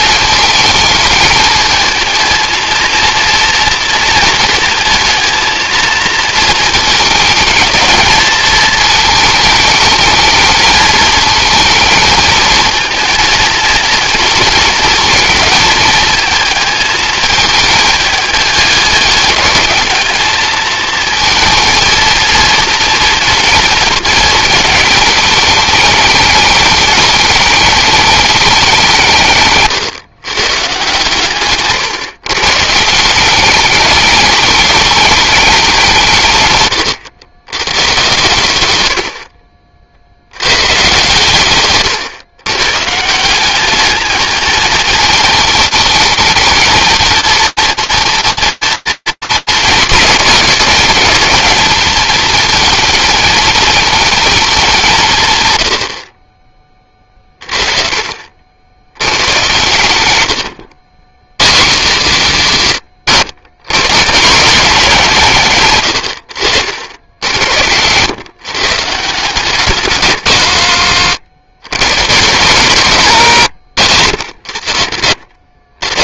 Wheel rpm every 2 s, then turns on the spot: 220, 230, 220, 220, 220, 220, 230, 230, 220, 210, 220, 230, 230, 210, 170, 140, 170, 210, 120, 80, 120, 140, 220, 220, 230, 220, 220, 220, 40, 80, 100, 150, 190, 70, 150, 120, 120, 70.
38-40